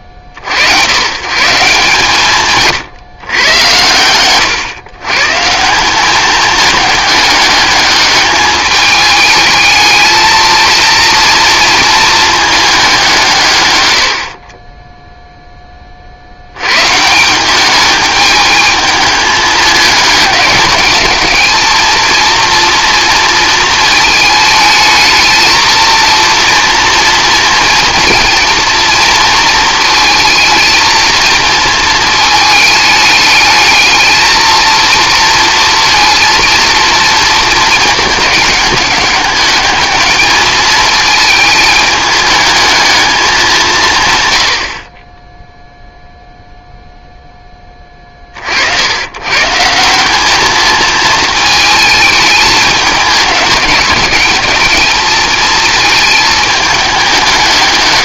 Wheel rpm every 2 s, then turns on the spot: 50, 140, 120, 210, 210, 220, 210, 20, 110, 220, 210, 230, 220, 230, 230, 230, 210, 230, 230, 210, 220, 220, 60, 0, 70, 220, 210, 210, 200.
none